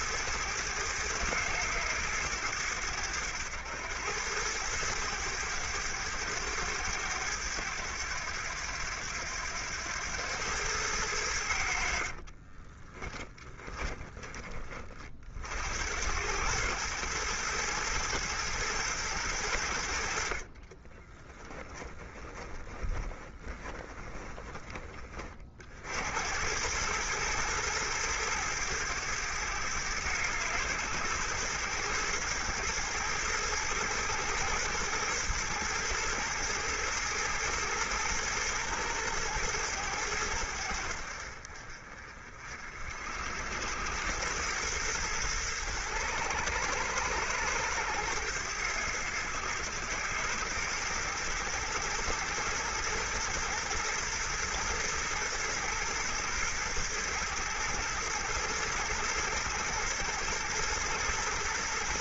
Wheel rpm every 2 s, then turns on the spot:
110, 90, 100, 100, 90, 100, 30, 30, 110, 110, 30, 20, 20, 100, 110, 110, 110, 110, 110, 110, 70, 60, 110, 90, 100, 110, 110, 110, 110, 110, 120.
12-14 20-24